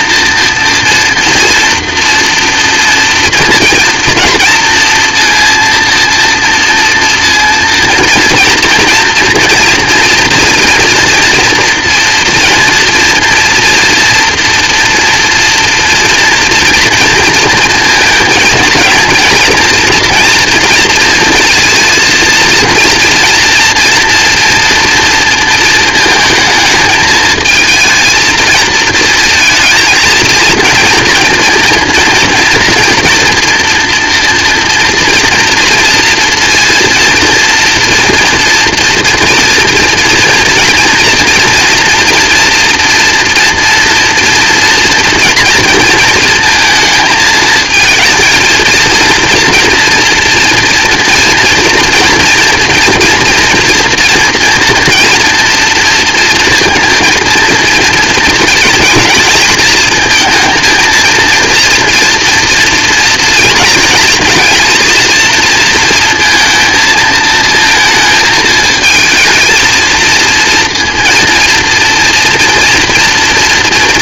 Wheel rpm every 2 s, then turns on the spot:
230, 230, 230, 230, 230, 230, 230, 230, 230, 220, 230, 230, 230, 220, 220, 230, 230, 230, 230, 240, 230, 230, 230, 220, 220, 230, 230, 240, 230, 230, 230, 230, 230, 230, 220, 230, 230.
none